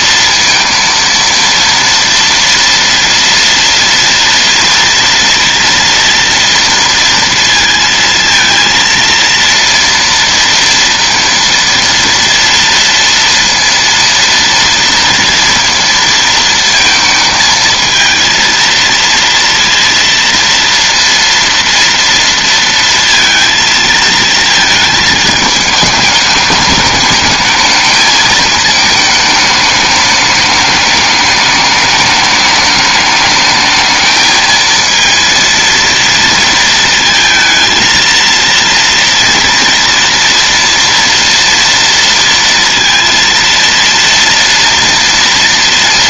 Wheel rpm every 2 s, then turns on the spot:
230, 230, 230, 230, 230, 230, 230, 230, 230, 230, 230, 230, 230, 210, 220, 210, 210, 220, 230, 230, 230, 230, 230.
none